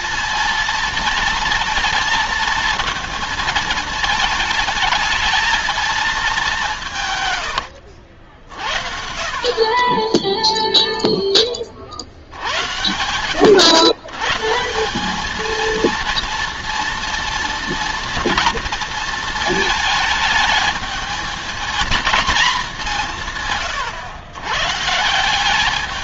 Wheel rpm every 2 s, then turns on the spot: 230, 230, 220, 150, 50, 0, 90, 180, 230, 230, 220, 190, 150.
6-8